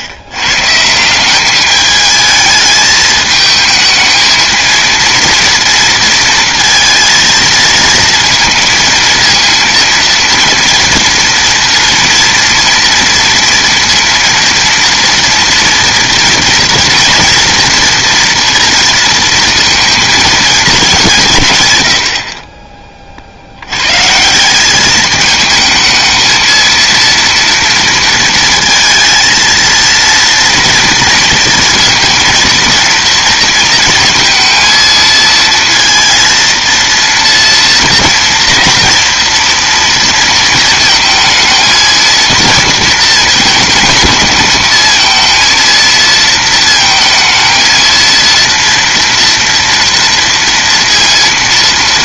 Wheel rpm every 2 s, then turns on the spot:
130, 220, 230, 230, 230, 230, 230, 230, 230, 230, 220, 30, 190, 230, 230, 230, 230, 220, 230, 230, 220, 230, 220, 230, 230, 230.
none